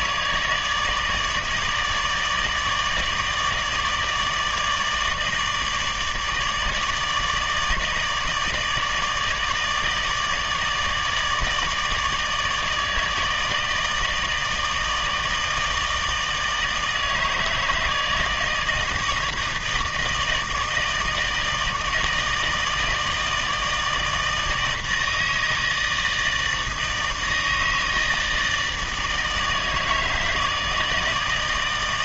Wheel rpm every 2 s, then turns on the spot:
150, 160, 160, 150, 160, 150, 160, 160, 160, 160, 160, 160, 160, 160, 160, 150.
none